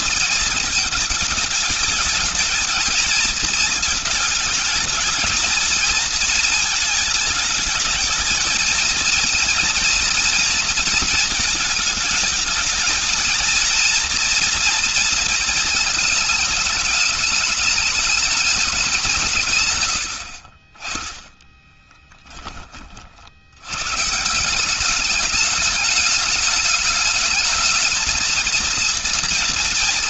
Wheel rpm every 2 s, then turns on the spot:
220, 220, 220, 230, 220, 230, 220, 230, 220, 210, 50, 20, 170, 210, 230.
none